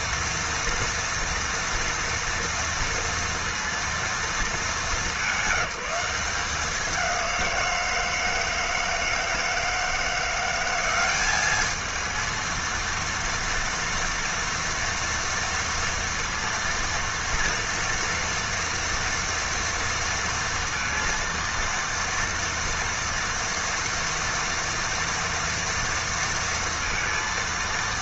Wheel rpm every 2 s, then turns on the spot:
230, 230, 200, 190, 160, 190, 230, 230, 230, 230, 230, 230, 230, 230.
none